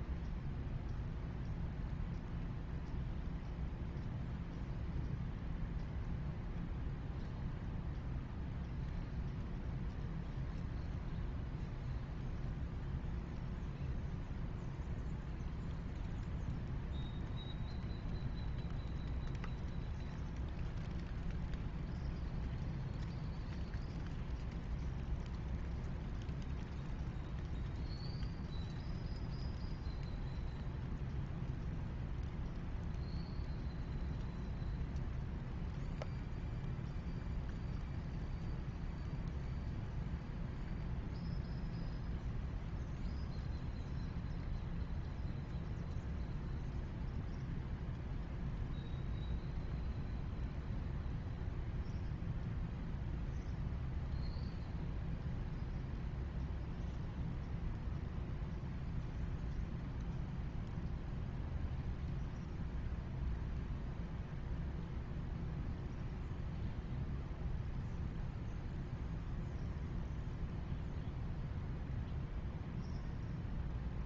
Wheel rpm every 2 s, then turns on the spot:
0, 0, 0, 0, 0, 0, 0, 0, 0, 0, 0, 0, 0, 0, 0, 0, 0, 0, 0, 0, 0, 0, 0, 0, 0, 0, 0, 0, 0, 0, 0, 0, 0, 0, 0, 0, 0.
none